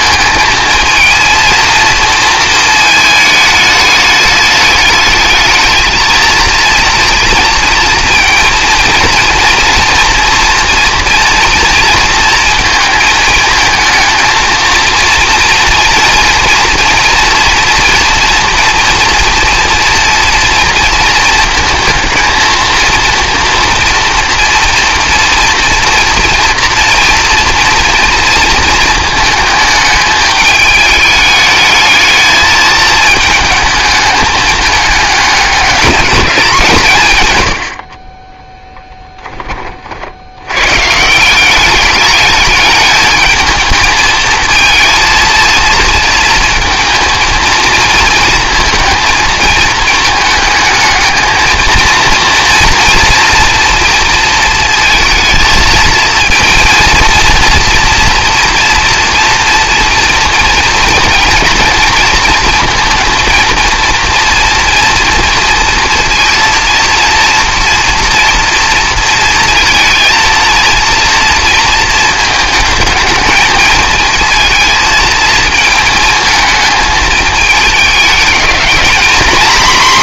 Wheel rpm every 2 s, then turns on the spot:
220, 220, 210, 230, 230, 240, 230, 230, 230, 240, 230, 230, 230, 230, 220, 210, 220, 210, 170, 10, 130, 210, 230, 230, 230, 220, 230, 220, 230, 230, 230, 230, 230, 230, 230, 230, 220, 230, 220, 220.
none